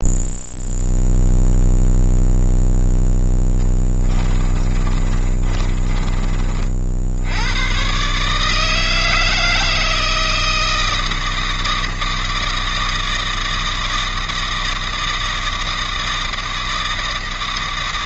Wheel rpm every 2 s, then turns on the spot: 0, 0, 30, 40, 160, 160, 160, 160, 160.
4-6